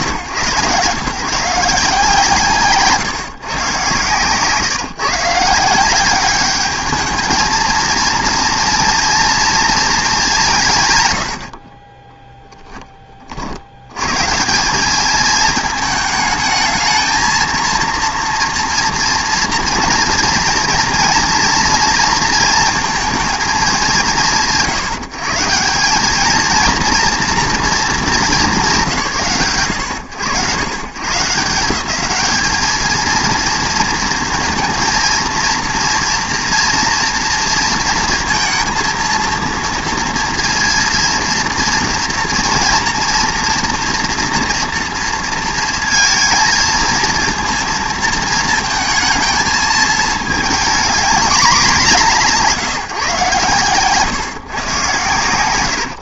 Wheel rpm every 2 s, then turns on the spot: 130, 140, 140, 210, 230, 160, 10, 190, 220, 240, 230, 230, 150, 230, 170, 110, 220, 230, 230, 230, 230, 230, 230, 220, 220, 220, 140, 120.
none